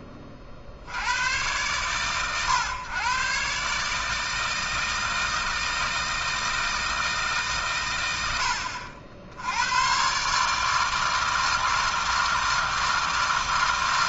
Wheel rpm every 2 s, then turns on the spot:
60, 120, 160, 160, 60, 160, 160.
none